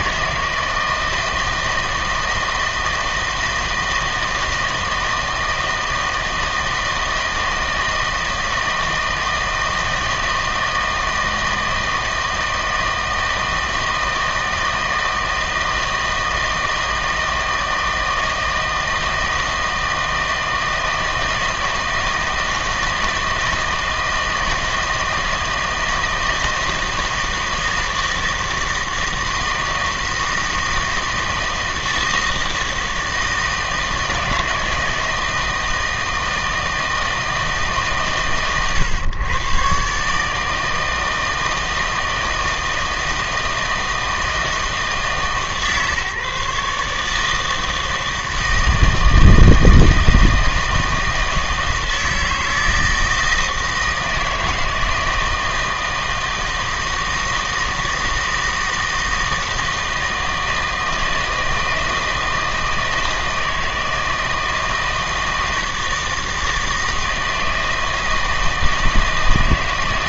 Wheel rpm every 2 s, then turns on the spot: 160, 160, 160, 160, 160, 160, 160, 160, 160, 160, 160, 160, 160, 160, 160, 160, 160, 160, 160, 120, 160, 160, 160, 150, 160, 160, 160, 160, 160, 160, 160, 160, 160, 160, 160.
none